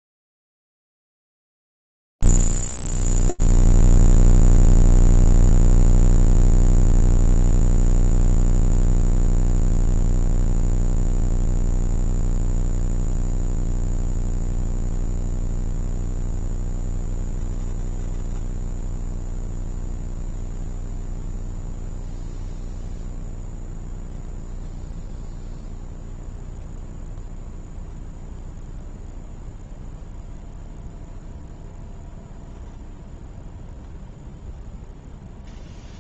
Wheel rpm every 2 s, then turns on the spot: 0, 0, 0, 0, 0, 0, 0, 0, 0, 0, 0, 0, 0, 0, 0, 0, 0, 0.
none